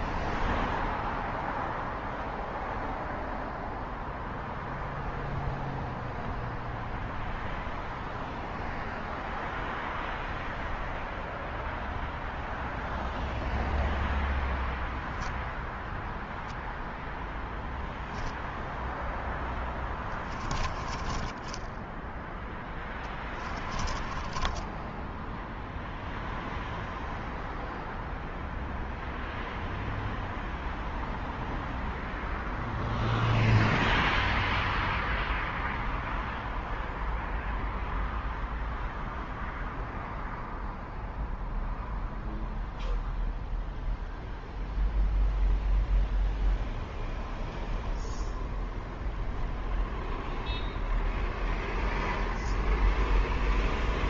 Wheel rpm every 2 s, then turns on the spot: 0, 0, 0, 0, 0, 0, 0, 0, 0, 10, 10, 10, 0, 0, 0, 0, 0, 0, 0, 0, 0, 0, 0, 0, 0, 0, 0.
18-24